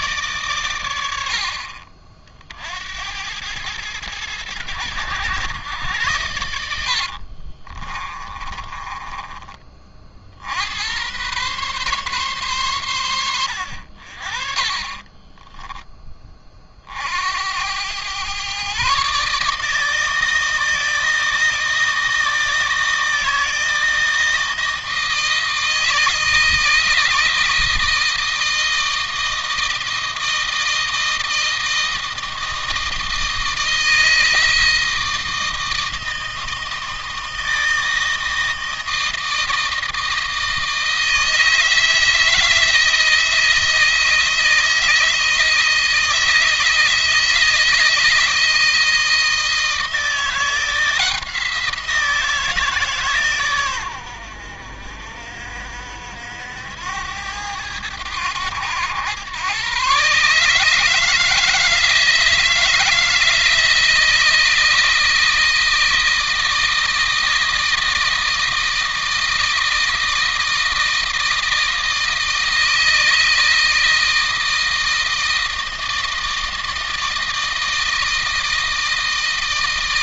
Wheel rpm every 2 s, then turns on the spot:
100, 70, 100, 70, 20, 90, 110, 30, 50, 130, 160, 160, 160, 160, 160, 160, 160, 160, 160, 160, 160, 160, 160, 160, 160, 170, 150, 60, 90, 100, 150, 160, 160, 160, 160, 160, 160, 160, 160, 160.
6-10 14-16